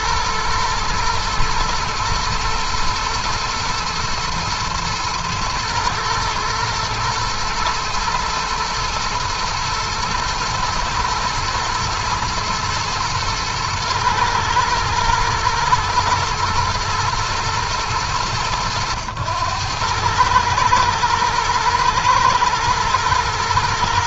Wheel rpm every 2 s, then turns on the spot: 120, 110, 110, 120, 110, 110, 110, 110, 120, 100, 110, 110.
none